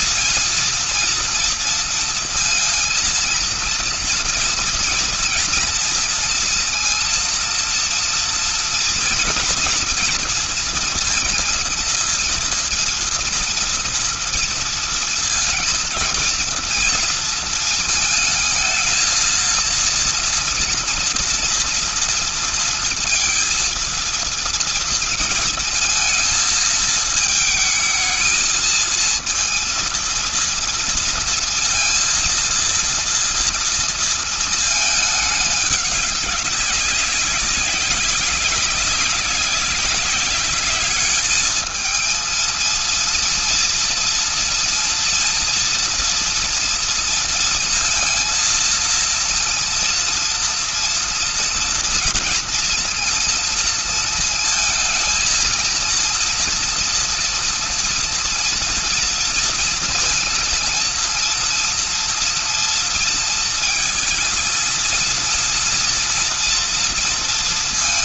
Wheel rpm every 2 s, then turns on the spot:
230, 230, 230, 230, 240, 230, 240, 230, 220, 220, 230, 230, 230, 220, 230, 230, 230, 210, 200, 190, 210, 230, 230, 230, 230, 230, 230, 220, 230, 230, 230, 230, 230, 230.
none